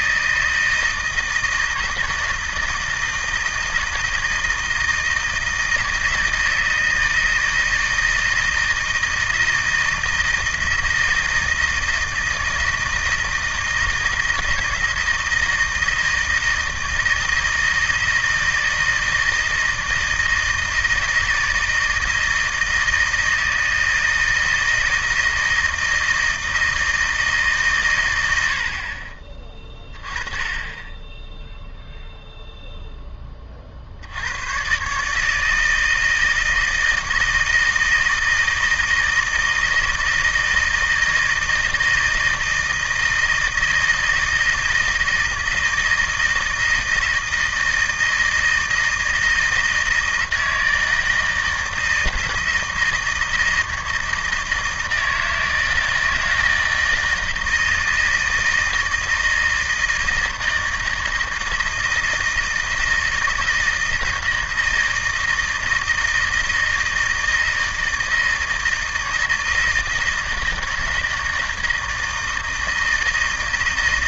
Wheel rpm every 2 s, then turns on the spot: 160, 160, 160, 160, 160, 160, 160, 160, 160, 160, 160, 160, 160, 160, 70, 20, 0, 120, 160, 160, 160, 160, 160, 160, 160, 160, 160, 160, 160, 160, 160, 160, 160, 160, 160, 160, 160.
none